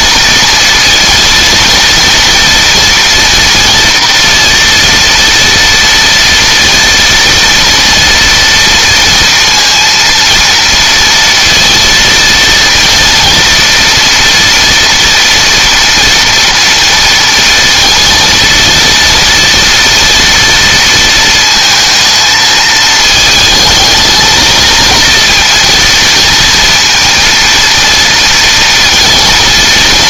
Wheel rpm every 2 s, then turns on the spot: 230, 230, 230, 230, 230, 230, 230, 230, 230, 230, 230, 220, 230, 230, 230.
none